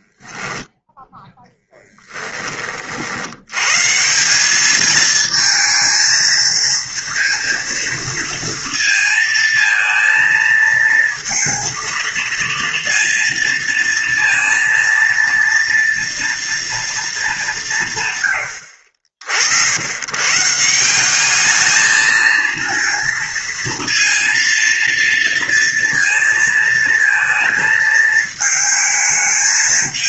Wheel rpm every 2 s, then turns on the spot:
10, 40, 210, 230, 230, 230, 230, 230, 230, 80, 170, 230, 230, 230, 220.
none